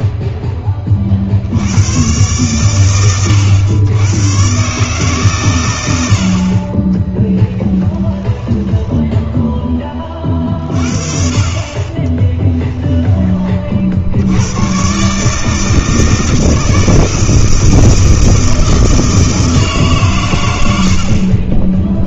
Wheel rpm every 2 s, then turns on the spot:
20, 110, 130, 30, 10, 40, 10, 110, 160, 160, 80.
6-10 12-14